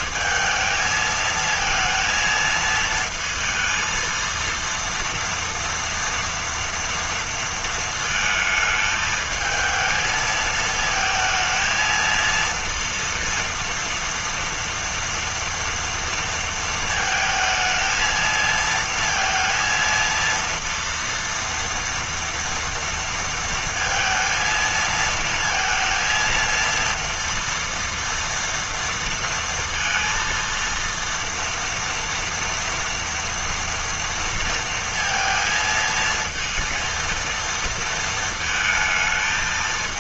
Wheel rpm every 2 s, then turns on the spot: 220, 230, 230, 230, 220, 220, 230, 230, 230, 230, 230, 230, 230, 230, 230, 230, 240, 230, 230, 220.
none